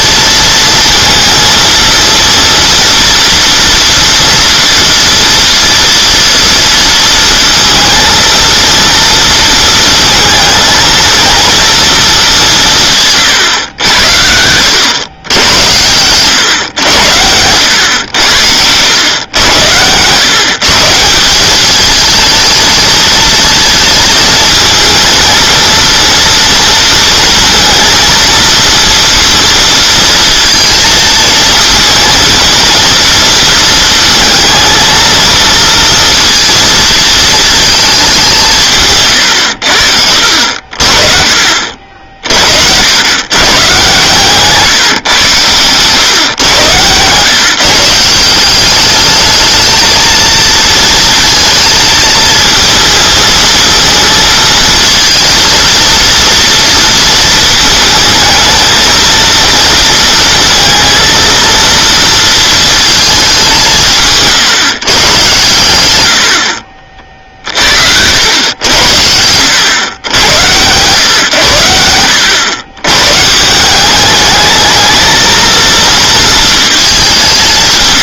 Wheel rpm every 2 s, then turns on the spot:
230, 230, 230, 230, 230, 230, 160, 100, 110, 100, 150, 220, 220, 230, 230, 220, 230, 220, 230, 150, 50, 90, 140, 120, 200, 230, 220, 220, 230, 220, 230, 230, 130, 40, 90, 110, 120, 220, 210.
none